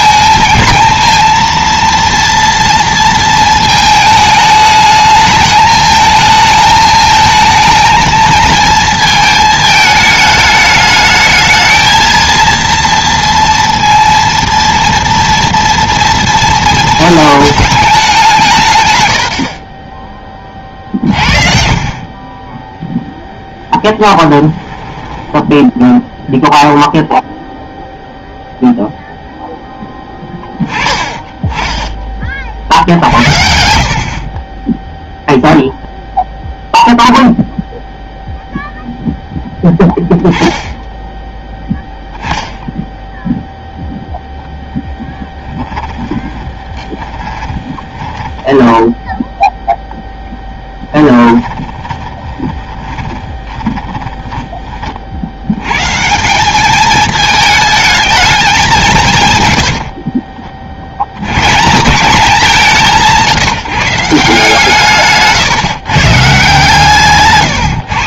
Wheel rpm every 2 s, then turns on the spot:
230, 230, 210, 220, 220, 220, 230, 230, 220, 120, 40, 10, 10, 0, 0, 10, 60, 0, 0, 0, 0, 0, 0, 20, 10, 10, 20, 30, 210, 180, 60, 180, 150, 150.
24-26 46-54